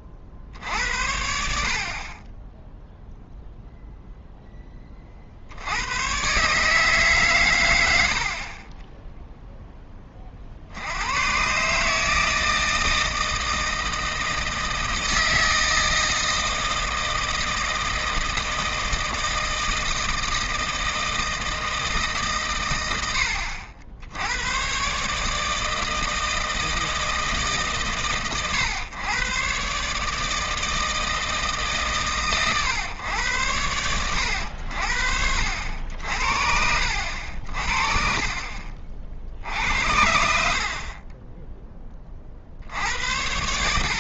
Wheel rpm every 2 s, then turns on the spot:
60, 0, 20, 150, 20, 70, 160, 160, 160, 160, 160, 100, 130, 160, 120, 160, 120, 80, 70, 40, 50, 70.
38-40